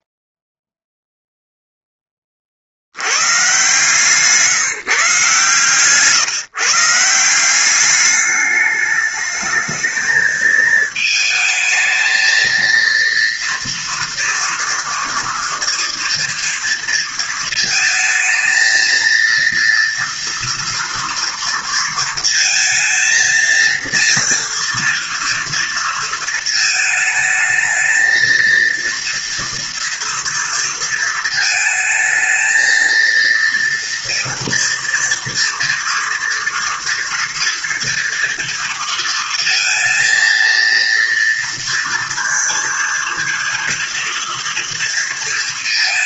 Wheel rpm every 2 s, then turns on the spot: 0, 100, 140, 160, 210, 220, 230, 230, 230, 220, 230, 230, 240, 220, 230, 230, 230, 230, 230, 230, 230, 230, 230.
none